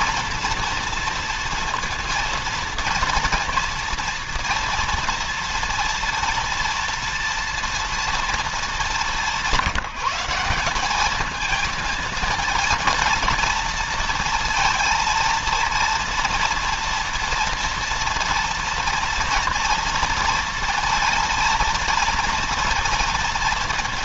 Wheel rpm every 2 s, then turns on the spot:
230, 230, 230, 230, 210, 200, 230, 230, 230, 230, 230, 230.
none